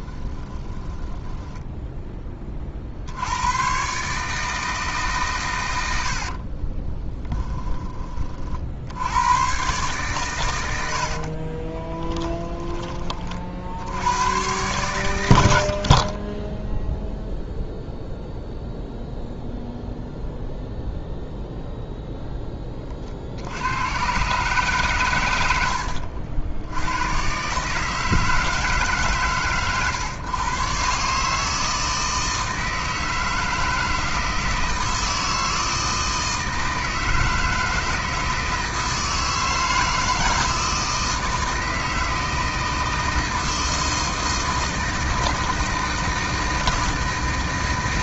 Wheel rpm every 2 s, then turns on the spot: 10, 60, 150, 20, 60, 90, 20, 110, 0, 0, 0, 30, 140, 90, 140, 130, 160, 160, 160, 160, 160, 160, 160, 160.
0-2 6-8